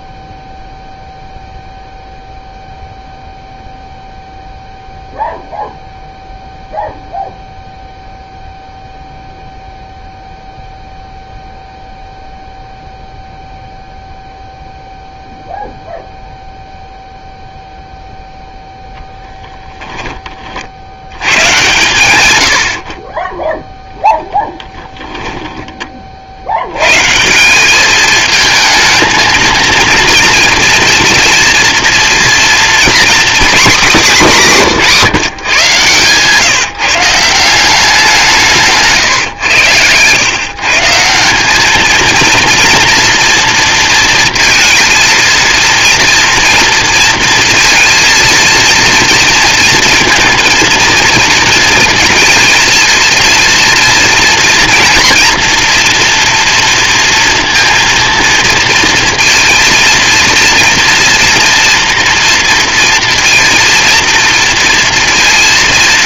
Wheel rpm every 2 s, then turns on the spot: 0, 0, 0, 0, 0, 0, 0, 0, 0, 10, 140, 0, 20, 200, 230, 230, 220, 130, 180, 100, 210, 230, 230, 230, 230, 230, 230, 240, 230, 230, 240, 230, 230.
18-20